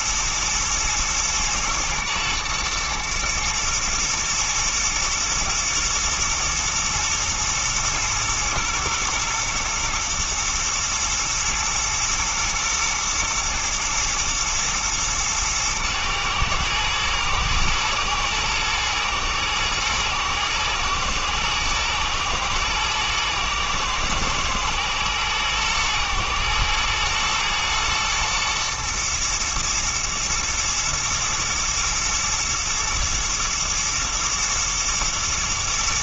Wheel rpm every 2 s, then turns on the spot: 120, 120, 120, 110, 110, 120, 120, 110, 110, 120, 120, 120, 120, 120, 120, 120, 110, 110.
none